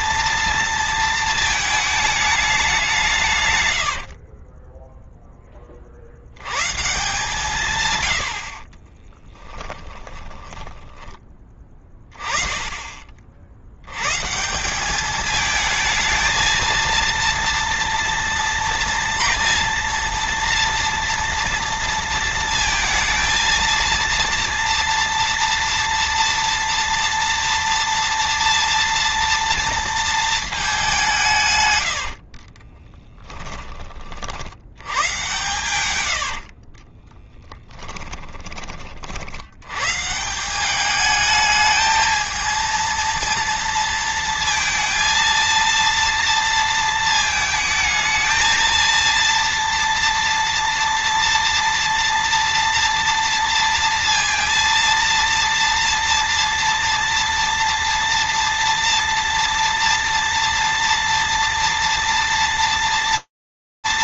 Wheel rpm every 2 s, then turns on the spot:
230, 190, 10, 120, 50, 10, 10, 160, 230, 230, 230, 230, 230, 230, 230, 210, 40, 70, 60, 30, 180, 220, 230, 230, 230, 230, 230, 230, 230, 230, 230, 230.
4-6 8-12 32-34 36-38